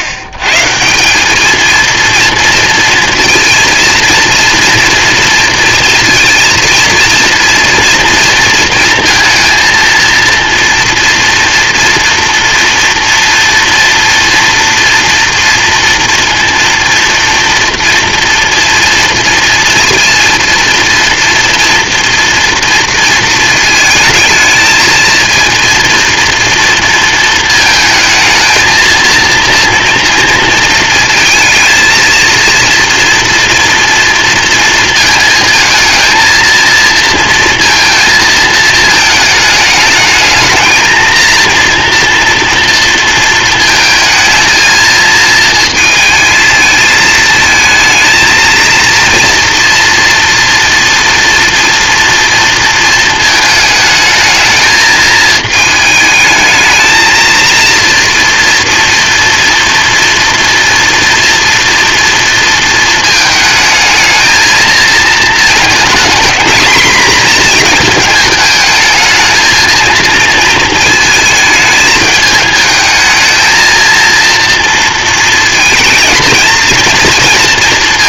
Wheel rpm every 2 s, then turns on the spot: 110, 230, 230, 230, 230, 230, 230, 230, 230, 230, 230, 230, 220, 230, 220, 230, 230, 230, 230, 220, 220, 230, 220, 220, 230, 230, 230, 220, 220, 240, 230, 230, 220, 230, 220, 230, 210, 230, 220.
none